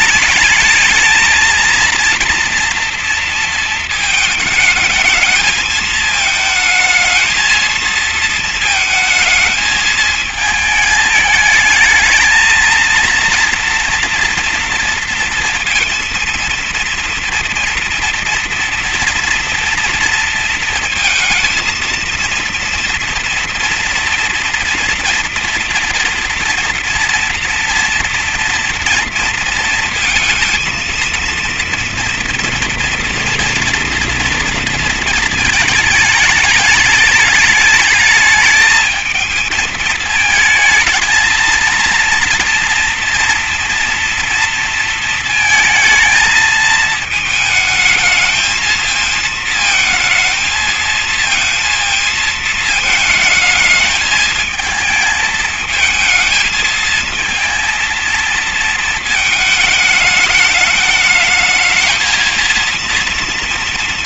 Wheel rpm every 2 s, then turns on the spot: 220, 230, 210, 230, 220, 220, 230, 230, 230, 230, 230, 230, 240, 230, 230, 230, 230, 230, 210, 220, 220, 230, 230, 220, 220, 230, 220, 220, 230, 220, 220, 230.
none